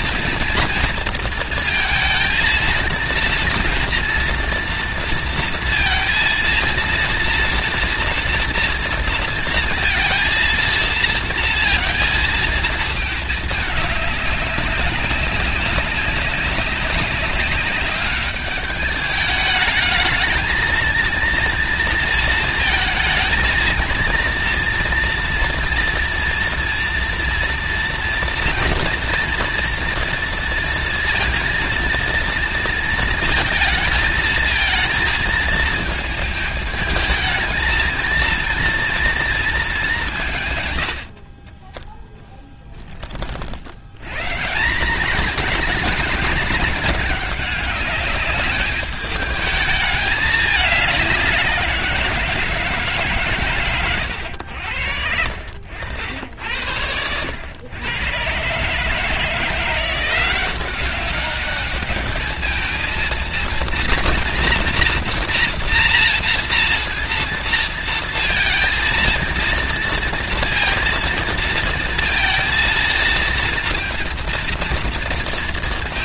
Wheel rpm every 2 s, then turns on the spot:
230, 230, 230, 230, 230, 230, 220, 200, 190, 200, 230, 220, 230, 230, 230, 230, 230, 220, 220, 230, 120, 10, 170, 200, 210, 200, 160, 80, 80, 140, 190, 220, 240, 240, 230, 230, 230, 230.
42-44